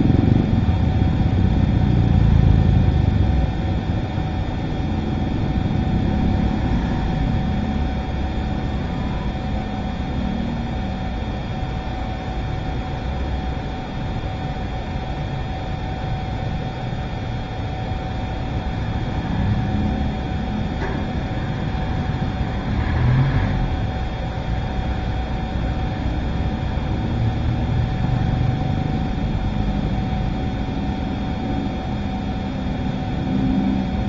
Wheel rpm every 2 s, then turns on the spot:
0, 0, 0, 0, 0, 0, 0, 0, 0, 0, 0, 0, 0, 0, 0, 0, 0.
none